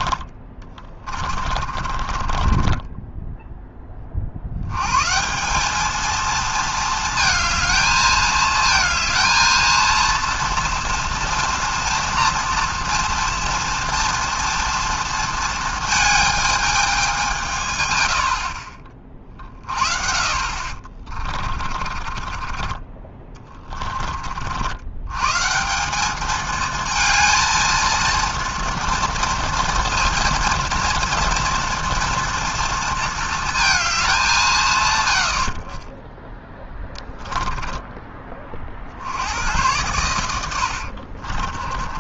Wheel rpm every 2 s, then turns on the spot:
30, 20, 120, 220, 220, 240, 230, 230, 210, 40, 40, 20, 80, 220, 230, 230, 230, 130, 10, 50, 70.
0-4 20-22 36-38 40-42